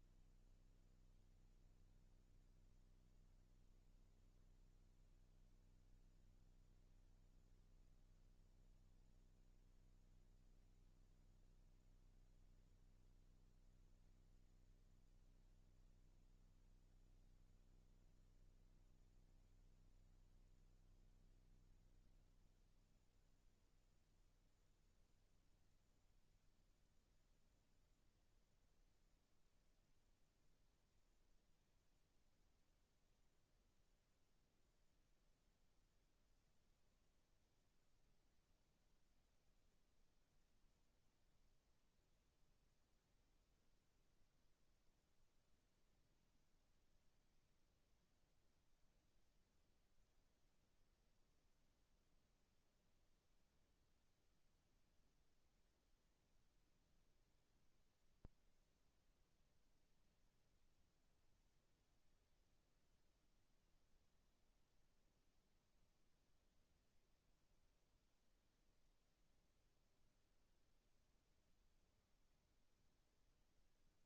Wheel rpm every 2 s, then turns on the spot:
0, 0, 0, 0, 0, 0, 0, 0, 0, 0, 0, 0, 0, 0, 0, 0, 0, 0, 0, 0, 0, 0, 0, 0, 0, 0, 0, 0, 0, 0, 0, 0, 0, 0, 0, 0, 0.
none